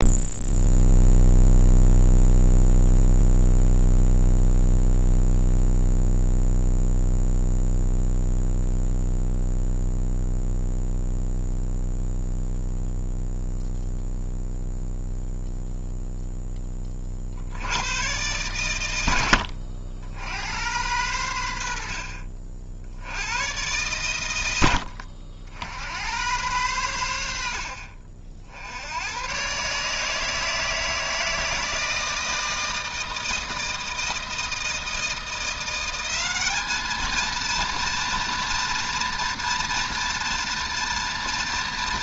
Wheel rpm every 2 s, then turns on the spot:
0, 0, 0, 0, 0, 0, 0, 0, 10, 110, 100, 60, 90, 100, 70, 160, 160, 160, 210, 230, 230.
none